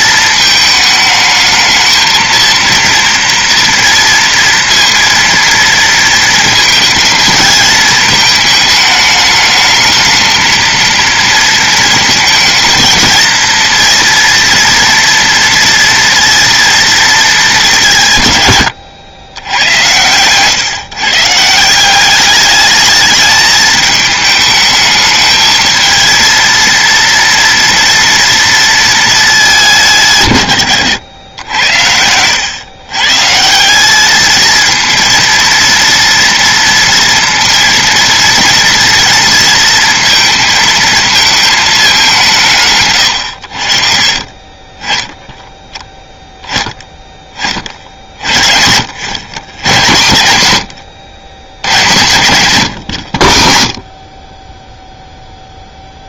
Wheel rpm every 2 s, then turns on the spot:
220, 230, 230, 220, 220, 230, 220, 230, 230, 100, 130, 210, 210, 230, 230, 120, 120, 220, 240, 240, 220, 140, 20, 20, 70, 100, 120, 10.
none